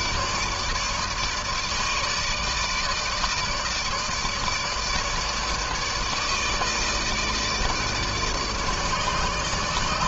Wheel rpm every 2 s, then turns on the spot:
150, 150, 150, 160, 150.
none